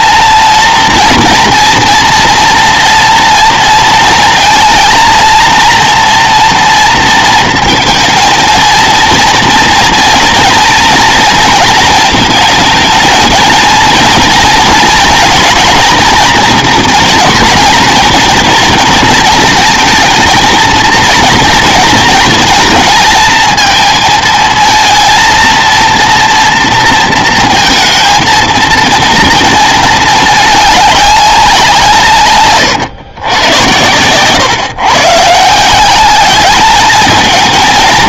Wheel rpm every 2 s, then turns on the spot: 240, 230, 230, 230, 230, 230, 230, 230, 240, 230, 230, 230, 230, 230, 230, 200, 130, 130, 210.
none